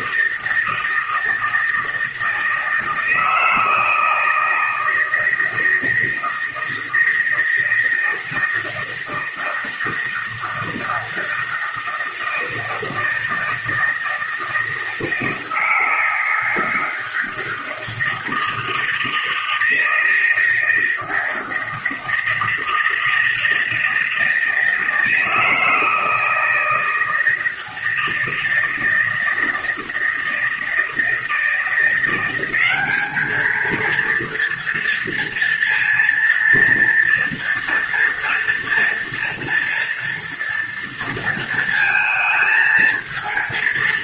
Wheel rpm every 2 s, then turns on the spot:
160, 160, 160, 160, 160, 160, 160, 160, 160, 160, 160, 160, 160, 160, 160, 160, 190, 230, 230, 230, 230, 220.
none